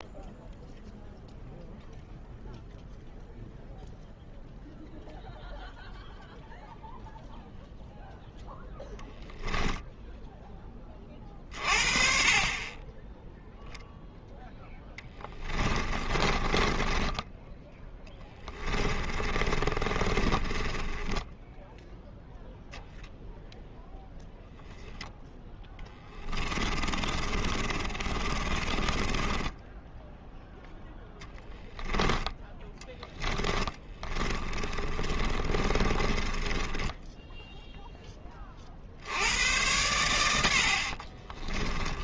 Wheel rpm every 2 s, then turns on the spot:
0, 0, 0, 0, 0, 30, 20, 20, 20, 30, 10, 0, 0, 30, 20, 0, 10, 40, 10, 60, 40.
14-22 26-30 32-38 40-42